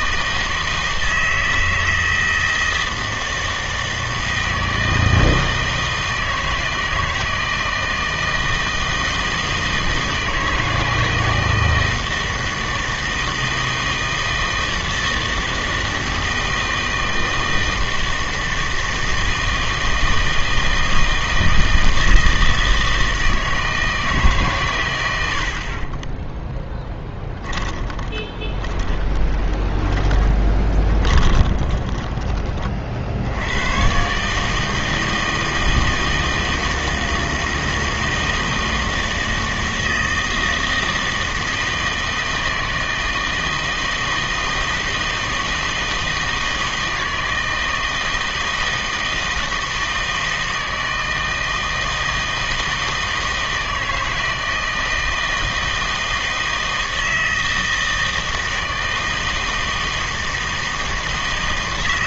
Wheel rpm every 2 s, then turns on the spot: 160, 160, 160, 160, 160, 160, 160, 160, 160, 160, 160, 160, 130, 10, 30, 20, 30, 150, 160, 160, 160, 160, 160, 160, 160, 160, 160, 160, 160, 160, 160.
26-32